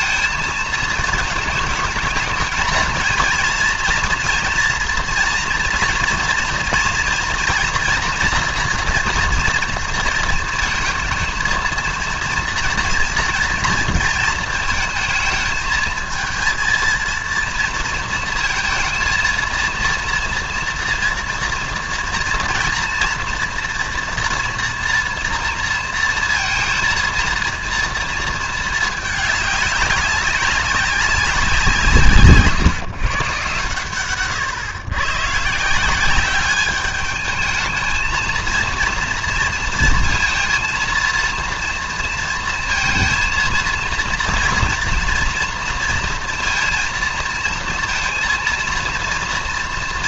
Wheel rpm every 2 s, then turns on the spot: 220, 220, 230, 230, 230, 230, 230, 220, 230, 230, 230, 240, 230, 230, 220, 190, 140, 130, 200, 230, 230, 230, 230, 230, 230.
none